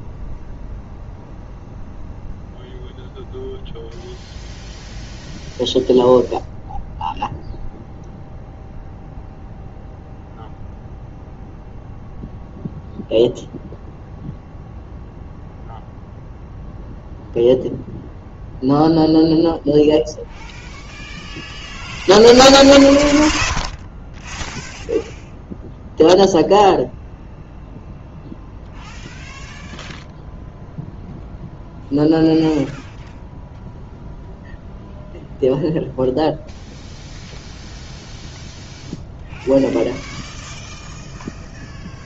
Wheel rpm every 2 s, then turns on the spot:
0, 0, 0, 0, 0, 0, 0, 0, 0, 0, 0, 20, 0, 0, 0, 0, 0, 0, 0, 0, 0.
none